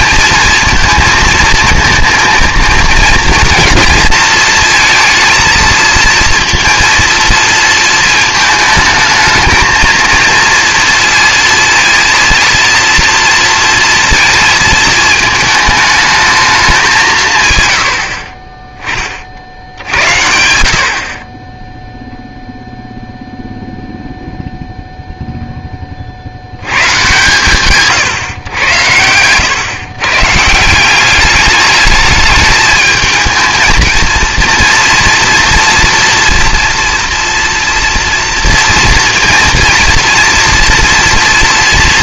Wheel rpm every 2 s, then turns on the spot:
230, 230, 230, 230, 220, 230, 230, 220, 210, 30, 80, 0, 0, 100, 120, 170, 220, 230, 230, 240, 230.
none